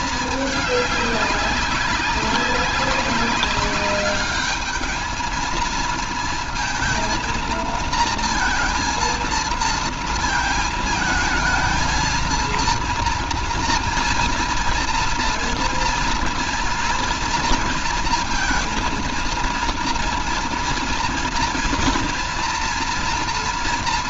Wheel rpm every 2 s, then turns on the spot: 200, 200, 220, 230, 230, 220, 230, 230, 230, 230, 230, 240.
none